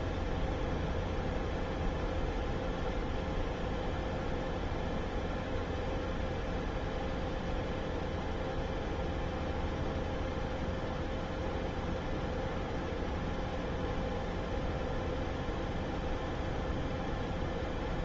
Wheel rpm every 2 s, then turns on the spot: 0, 0, 0, 0, 0, 0, 0, 0, 0.
none